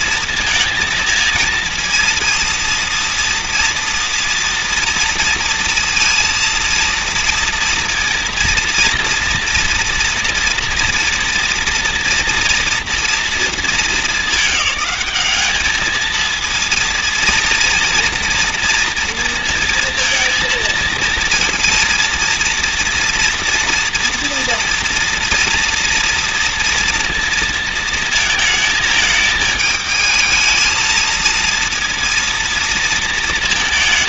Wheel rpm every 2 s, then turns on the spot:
230, 230, 230, 230, 230, 230, 240, 210, 230, 230, 230, 240, 230, 230, 220, 220, 230.
none